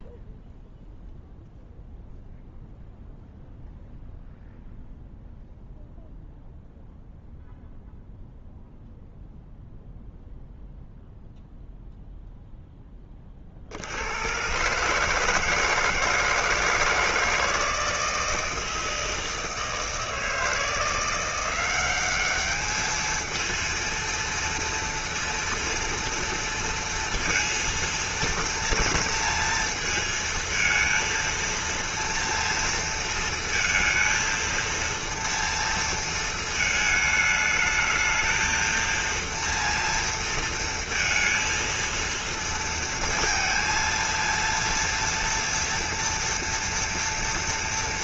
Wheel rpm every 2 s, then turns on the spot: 0, 0, 0, 0, 0, 0, 0, 130, 160, 160, 160, 210, 230, 230, 240, 220, 230, 230, 220, 230, 230, 230, 230, 240.
none